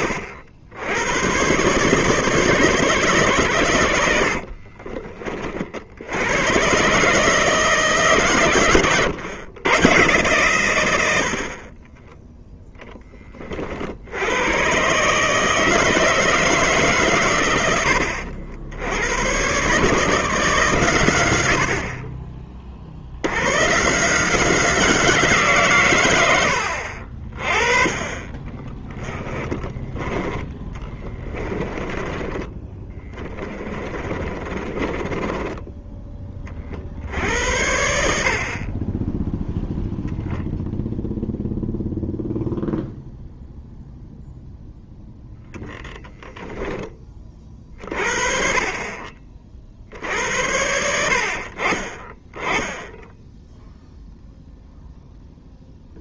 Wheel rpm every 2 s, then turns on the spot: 70, 140, 40, 140, 120, 90, 20, 150, 120, 110, 90, 100, 170, 50, 20, 30, 20, 20, 60, 20, 0, 0, 0, 10, 40, 90, 10, 0.
8-10 28-36